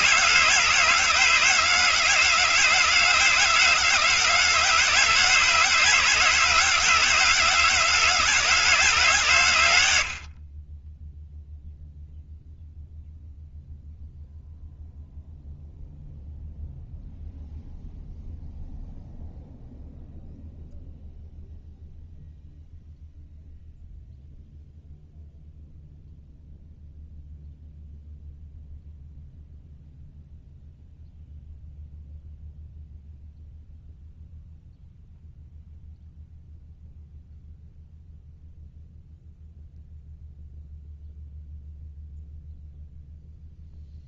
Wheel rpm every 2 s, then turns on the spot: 160, 160, 160, 160, 160, 40, 0, 0, 0, 0, 0, 0, 0, 0, 0, 0, 0, 0, 0, 0, 0, 0.
none